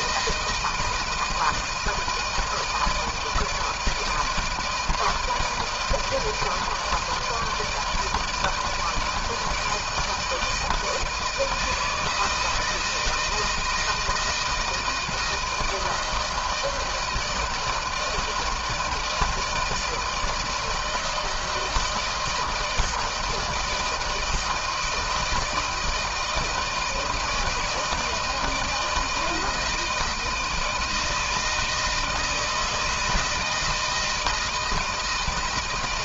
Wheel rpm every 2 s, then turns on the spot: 160, 160, 160, 160, 160, 160, 160, 160, 160, 160, 160, 160, 160, 160, 160, 160, 160, 160.
none